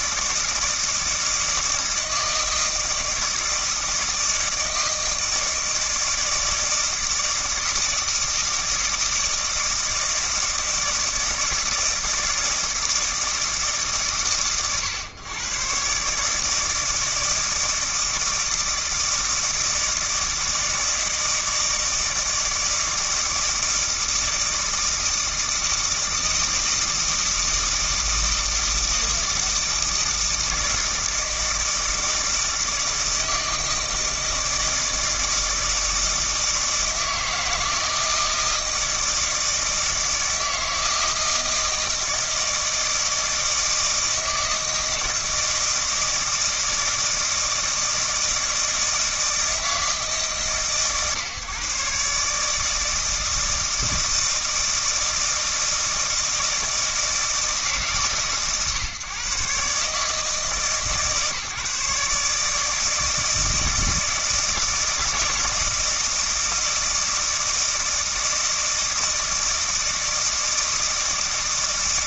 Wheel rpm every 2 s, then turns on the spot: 160, 160, 160, 160, 160, 160, 160, 110, 160, 160, 160, 160, 160, 160, 160, 160, 160, 160, 160, 160, 160, 160, 160, 160, 160, 150, 150, 160, 160, 140, 150, 150, 160, 160, 160, 160.
none